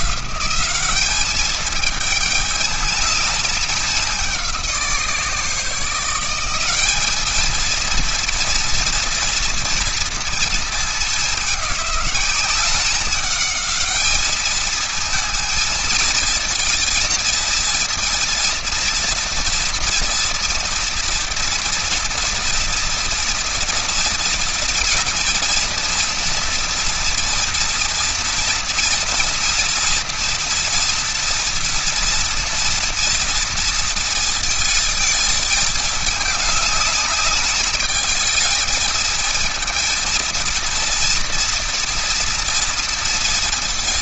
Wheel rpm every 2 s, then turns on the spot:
210, 210, 160, 210, 230, 210, 200, 220, 230, 230, 230, 230, 230, 230, 230, 230, 240, 230, 210, 220, 230, 230.
none